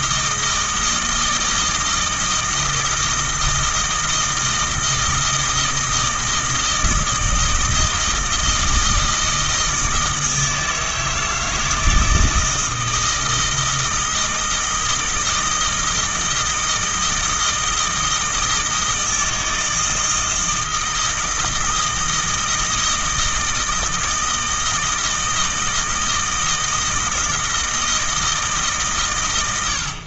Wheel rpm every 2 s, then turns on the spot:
160, 160, 160, 160, 160, 160, 160, 160, 160, 160, 160, 160, 160, 160, 130.
none